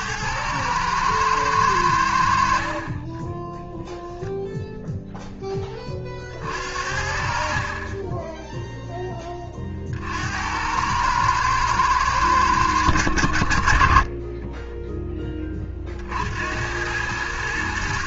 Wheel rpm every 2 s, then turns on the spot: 110, 50, 0, 60, 0, 90, 90, 10, 90.
14-16